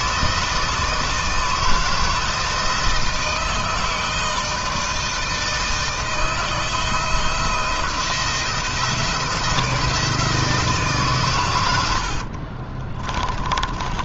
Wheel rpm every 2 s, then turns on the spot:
160, 160, 160, 160, 170, 160, 40.
12-14